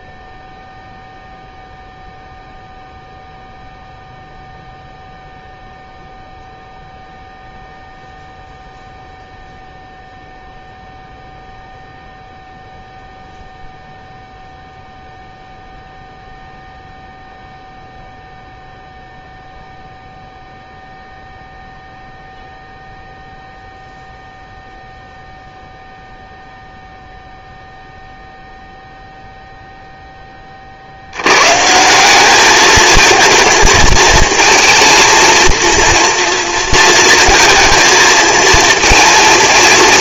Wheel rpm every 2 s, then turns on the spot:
0, 0, 0, 0, 0, 0, 0, 0, 0, 0, 0, 0, 0, 0, 0, 40, 210, 230, 230, 230.
none